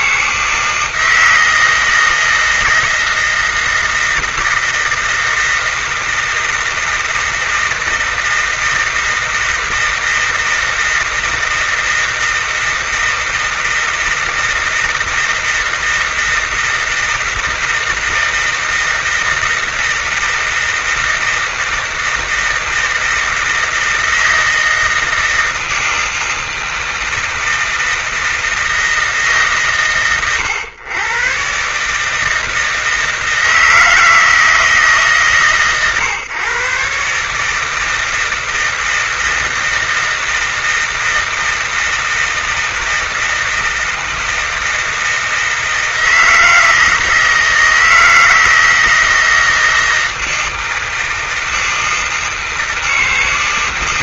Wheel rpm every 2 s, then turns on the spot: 160, 160, 160, 160, 160, 160, 160, 160, 160, 160, 160, 160, 160, 160, 160, 130, 160, 160, 130, 160, 160, 160, 160, 160, 160, 160, 160.
none